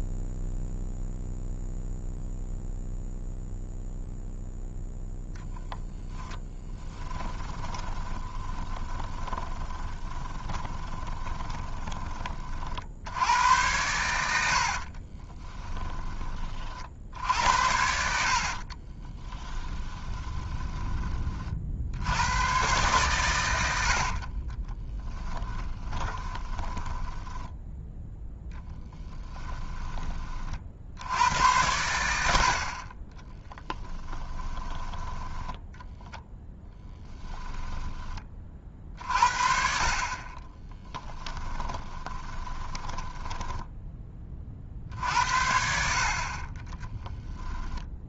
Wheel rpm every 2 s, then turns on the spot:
0, 0, 0, 10, 20, 20, 70, 50, 50, 30, 20, 130, 20, 10, 10, 70, 30, 10, 10, 40, 10, 20, 60, 10.
6-12 14-16 18-20 24-30 36-38 40-44 46-48